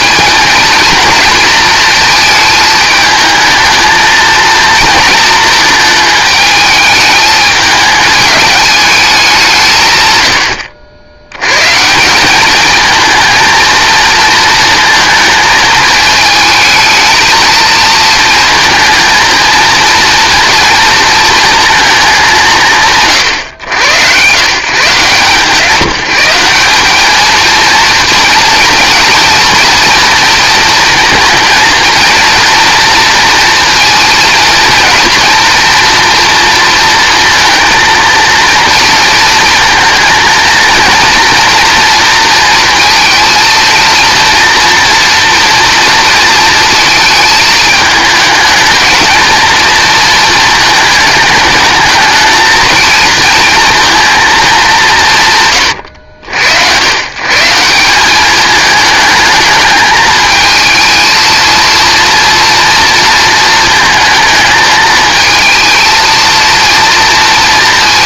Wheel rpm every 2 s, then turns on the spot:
230, 220, 230, 220, 210, 80, 220, 230, 220, 230, 230, 130, 150, 210, 230, 230, 230, 240, 230, 230, 230, 230, 230, 220, 220, 220, 230, 190, 120, 210, 220, 230, 220, 230.
none